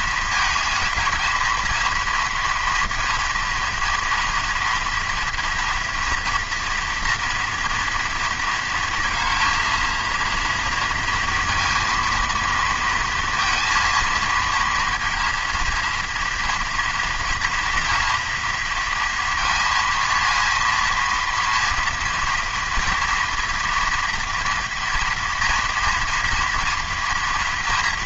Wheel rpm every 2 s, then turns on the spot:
220, 230, 230, 230, 230, 230, 230, 230, 230, 230, 230, 230, 230, 230.
none